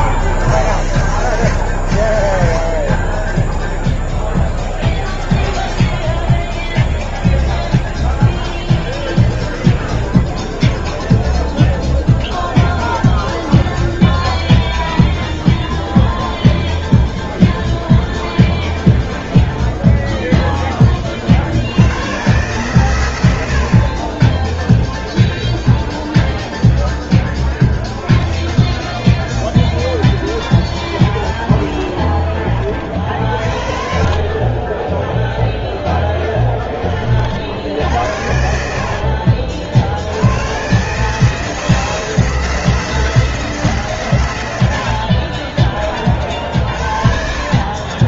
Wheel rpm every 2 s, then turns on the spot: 100, 50, 0, 0, 0, 0, 0, 0, 0, 0, 10, 120, 0, 0, 20, 20, 30, 20, 30, 60, 120, 160, 90, 50.
38-40